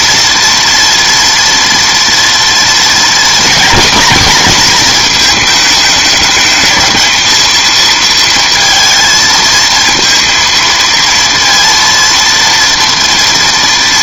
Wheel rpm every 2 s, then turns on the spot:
240, 230, 240, 220, 230, 230, 230.
none